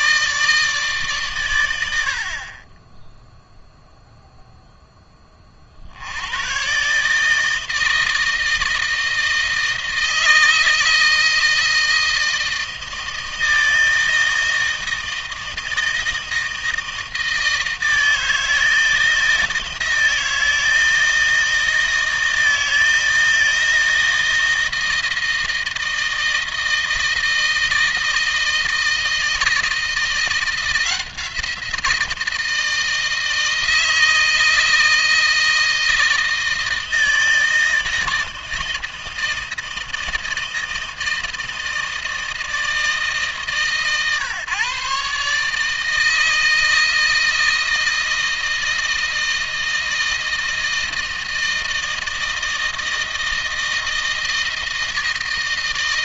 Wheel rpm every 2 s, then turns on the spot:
140, 20, 10, 130, 160, 160, 160, 160, 160, 160, 160, 160, 160, 160, 160, 170, 160, 160, 160, 160, 160, 160, 140, 160, 160, 160, 160, 160.
none